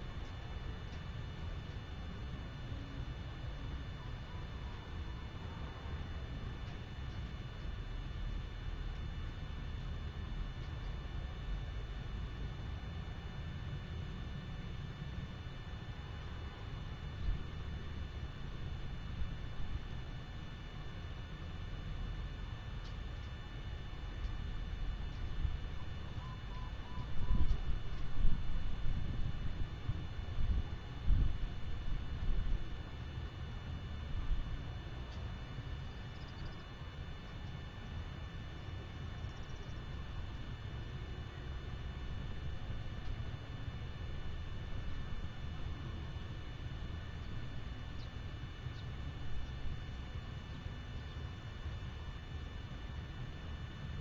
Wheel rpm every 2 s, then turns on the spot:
0, 0, 0, 0, 0, 0, 0, 0, 0, 0, 0, 0, 0, 0, 0, 0, 0, 0, 0, 0, 0, 0, 0, 0, 0, 0, 0.
none